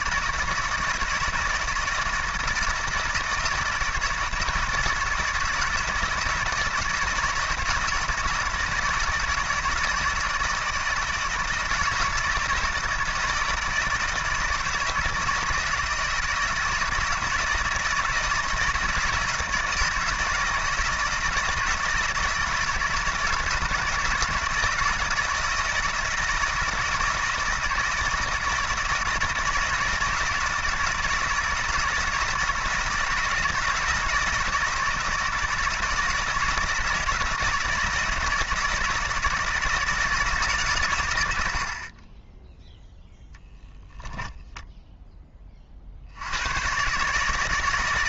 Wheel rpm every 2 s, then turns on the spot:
160, 160, 160, 160, 160, 160, 160, 160, 160, 160, 160, 160, 160, 160, 160, 160, 160, 160, 160, 160, 140, 0, 10, 110.
none